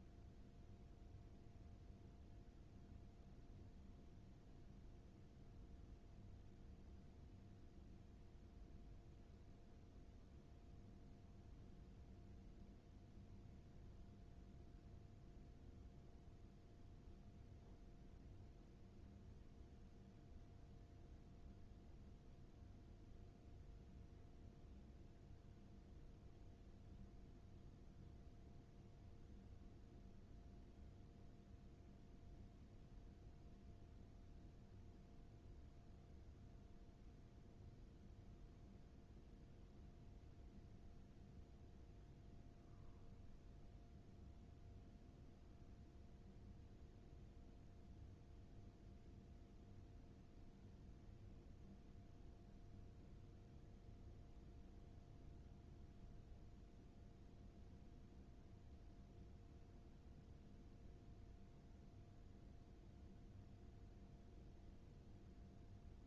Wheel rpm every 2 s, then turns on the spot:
0, 0, 0, 0, 0, 0, 0, 0, 0, 0, 0, 0, 0, 0, 0, 0, 0, 0, 0, 0, 0, 0, 0, 0, 0, 0, 0, 0, 0, 0, 0, 0, 0.
none